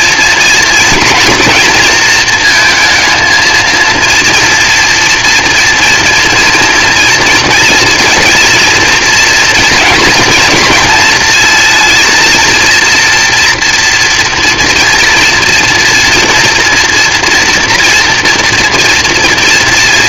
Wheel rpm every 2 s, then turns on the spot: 230, 230, 230, 240, 230, 230, 230, 230, 230, 230.
none